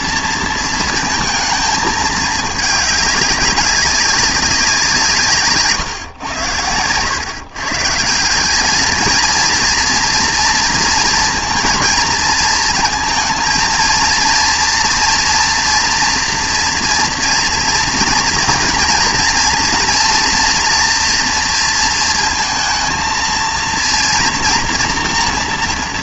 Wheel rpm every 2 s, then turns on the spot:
230, 210, 190, 100, 210, 230, 230, 230, 240, 230, 230, 230, 240.
none